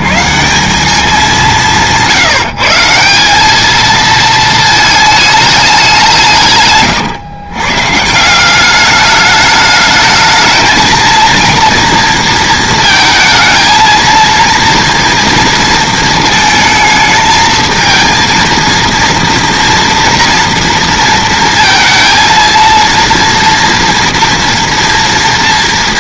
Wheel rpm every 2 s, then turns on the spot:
90, 170, 220, 160, 180, 220, 230, 230, 220, 230, 230, 230, 240.
none